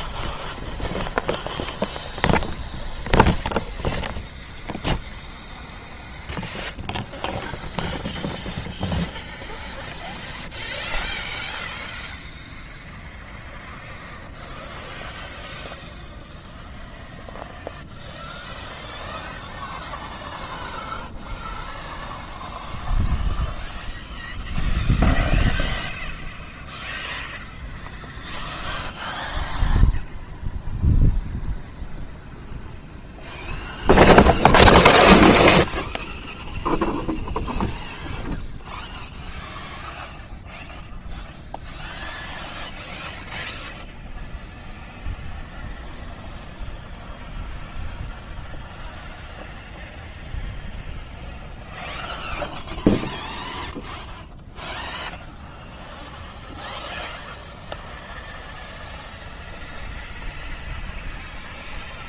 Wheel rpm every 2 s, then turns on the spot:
0, 0, 0, 0, 0, 0, 0, 0, 0, 0, 0, 0, 0, 0, 0, 0, 0, 0, 0, 0, 0, 0, 0, 0, 0, 0, 0, 0, 0, 0, 0.
none